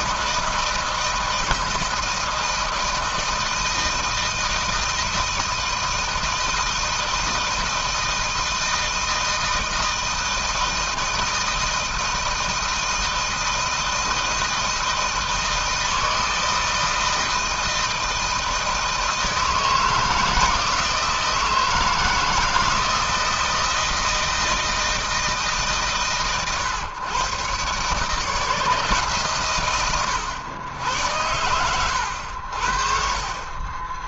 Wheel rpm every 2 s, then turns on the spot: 160, 160, 160, 160, 160, 160, 160, 160, 160, 160, 160, 160, 160, 110, 150, 100, 60.
none